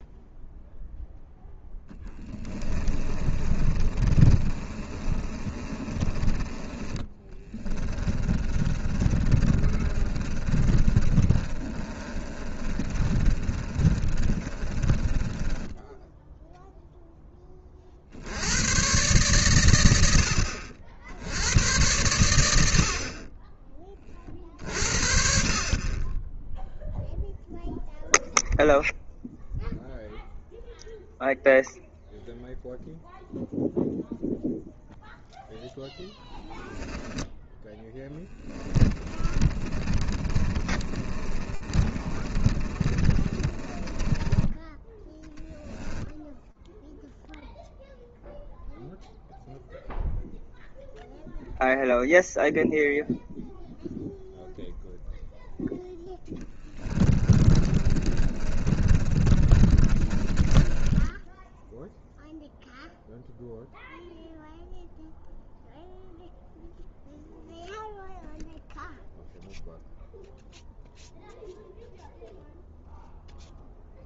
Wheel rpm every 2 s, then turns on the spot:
0, 20, 30, 20, 30, 30, 30, 30, 0, 110, 60, 60, 50, 0, 0, 0, 0, 0, 10, 20, 30, 30, 20, 0, 0, 0, 0, 0, 20, 30, 20, 0, 0, 0, 0, 0, 0.
2-6 8-16 38-44 56-62